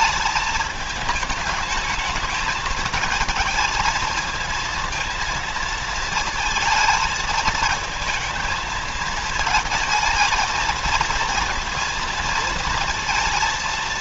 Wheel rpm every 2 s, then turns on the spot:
210, 220, 230, 220, 220, 220, 230.
none